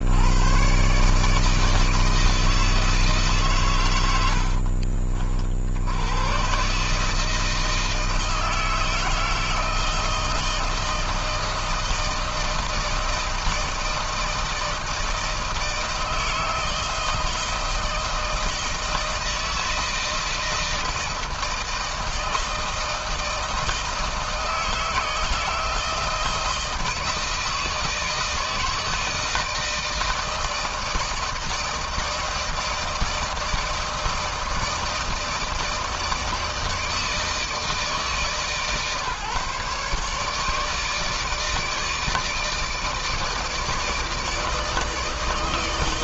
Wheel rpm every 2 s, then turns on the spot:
110, 160, 80, 110, 160, 170, 160, 160, 160, 160, 160, 160, 160, 160, 160, 160, 160, 160, 160, 150, 150, 160, 160.
4-6